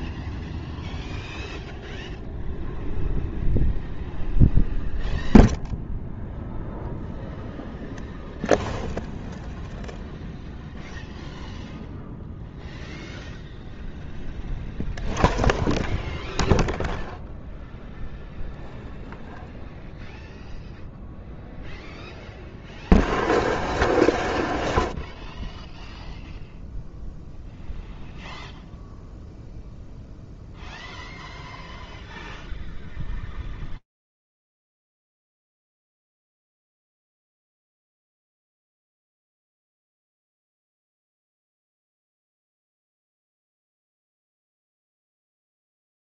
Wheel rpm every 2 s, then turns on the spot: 0, 0, 0, 0, 0, 0, 0, 0, 0, 0, 0, 0, 0, 0, 0, 0, 0, 0, 0, 0, 0, 0, 0.
none